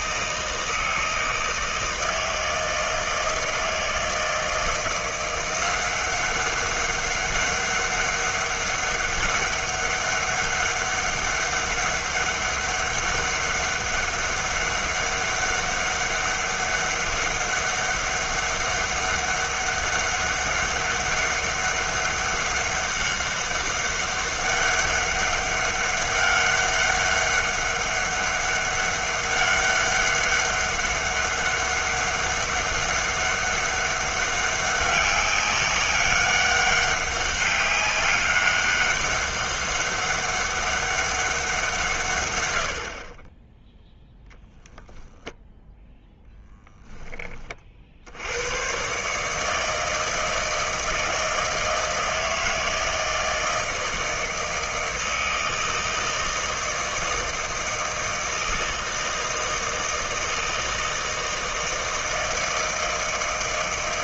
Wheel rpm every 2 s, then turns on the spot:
160, 160, 160, 190, 200, 200, 200, 200, 200, 200, 200, 200, 200, 200, 200, 200, 200, 200, 200, 200, 200, 80, 0, 10, 120, 160, 160, 160, 160, 160, 160, 160.
none